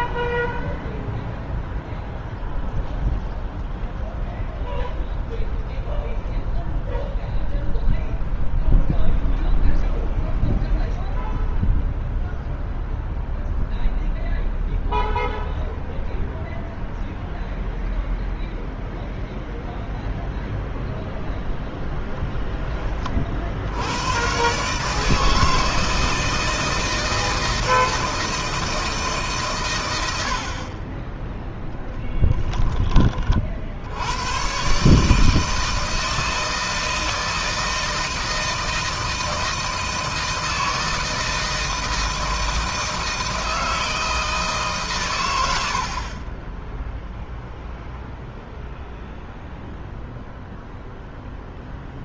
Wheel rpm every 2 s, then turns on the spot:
0, 0, 0, 0, 0, 0, 0, 0, 0, 0, 0, 30, 150, 160, 150, 20, 30, 140, 160, 160, 160, 160, 120, 0, 0, 0.
none